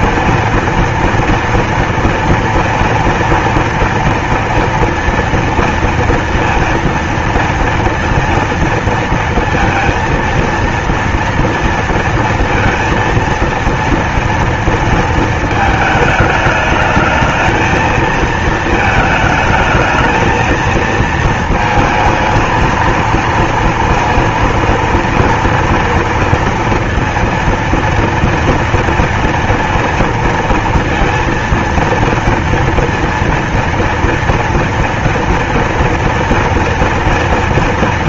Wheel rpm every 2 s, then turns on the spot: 230, 230, 230, 230, 230, 230, 230, 230, 210, 220, 220, 230, 230, 230, 230, 230, 230, 240, 230.
none